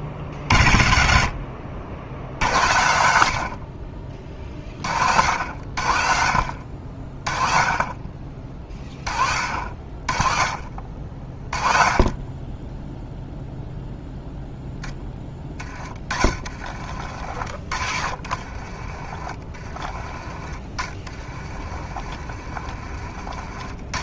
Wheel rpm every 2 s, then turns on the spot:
50, 70, 40, 50, 30, 40, 20, 10, 50, 40, 30, 50.
16-24